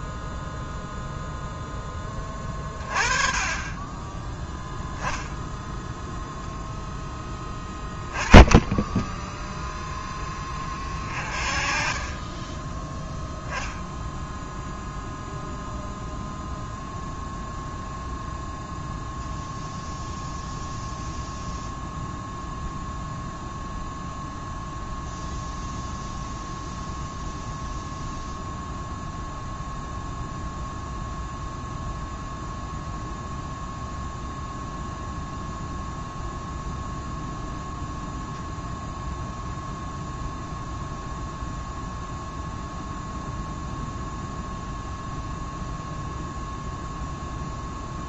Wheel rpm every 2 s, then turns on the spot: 0, 20, 10, 0, 10, 30, 10, 0, 0, 0, 0, 0, 0, 0, 0, 0, 0, 0, 0, 0, 0, 0, 0, 0.
8-10